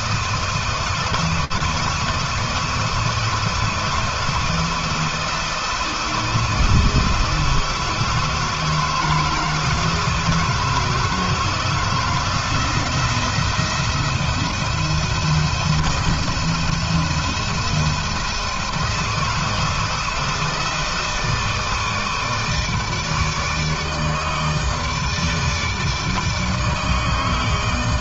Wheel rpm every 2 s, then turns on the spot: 160, 160, 160, 160, 160, 160, 170, 170, 170, 160, 160, 160, 160, 160.
none